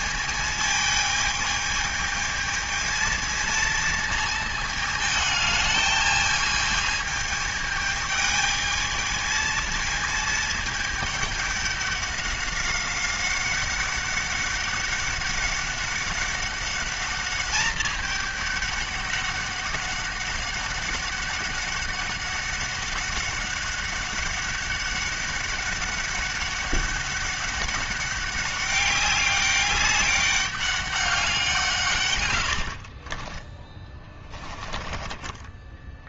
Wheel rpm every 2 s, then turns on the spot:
220, 220, 220, 220, 220, 220, 200, 200, 200, 200, 200, 200, 200, 200, 200, 190, 50, 20.
32-34